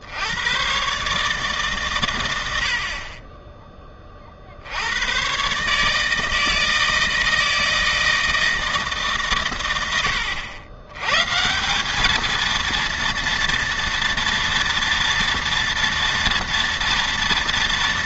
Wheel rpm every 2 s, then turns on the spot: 130, 50, 90, 160, 150, 100, 230, 230, 230.
none